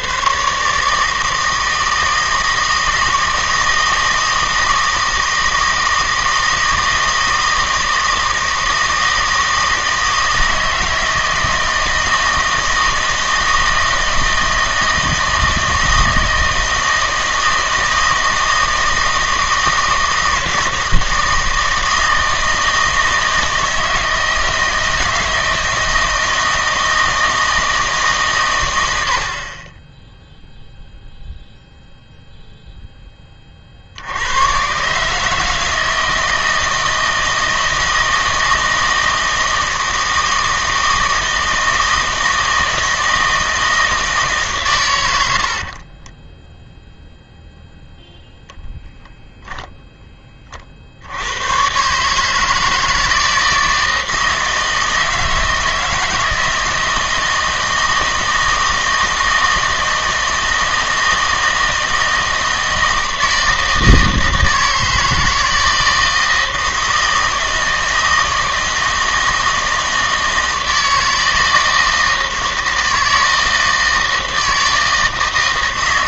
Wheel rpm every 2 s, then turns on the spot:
150, 160, 160, 160, 160, 160, 160, 160, 160, 160, 160, 160, 160, 160, 90, 0, 0, 130, 160, 160, 160, 160, 110, 0, 0, 50, 160, 160, 160, 160, 160, 160, 160, 160, 160, 160, 160, 160.
none